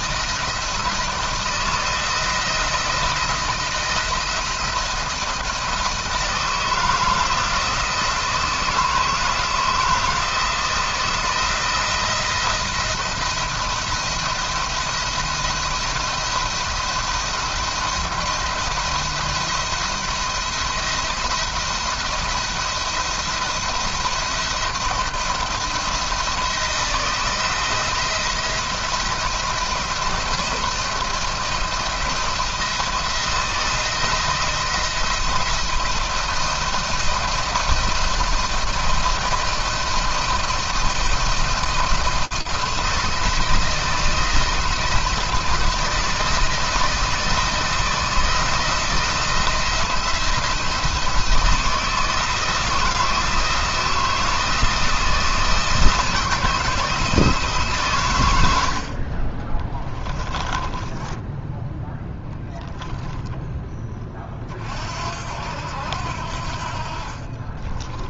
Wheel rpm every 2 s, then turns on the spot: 160, 170, 160, 160, 160, 160, 170, 170, 170, 170, 170, 170, 170, 160, 160, 170, 160, 170, 160, 170, 170, 170, 170, 160, 170, 170, 170, 170, 160, 60, 10, 0, 60, 50.
66-68